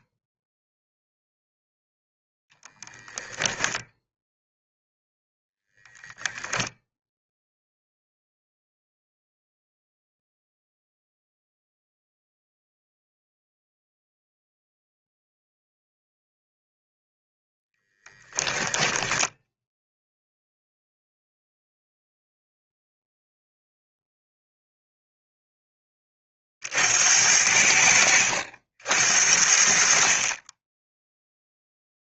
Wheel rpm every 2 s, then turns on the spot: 0, 10, 0, 0, 0, 0, 0, 0, 0, 10, 0, 0, 0, 60, 70, 10.
none